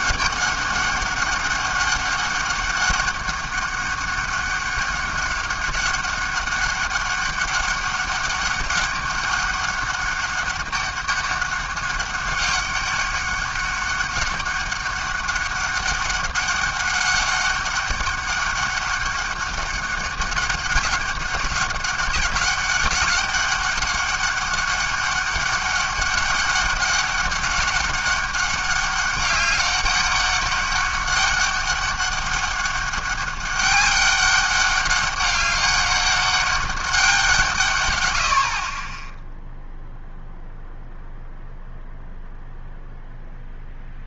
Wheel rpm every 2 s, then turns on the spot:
200, 200, 200, 200, 200, 200, 200, 200, 200, 200, 200, 200, 200, 200, 200, 200, 200, 200, 200, 40, 0, 0.
none